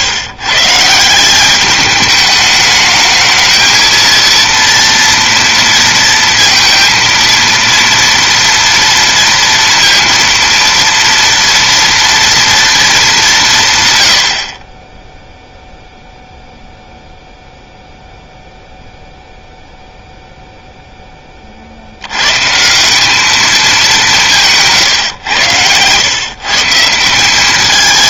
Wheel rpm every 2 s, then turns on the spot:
140, 210, 230, 230, 230, 230, 230, 30, 0, 0, 0, 170, 150, 150.
24-26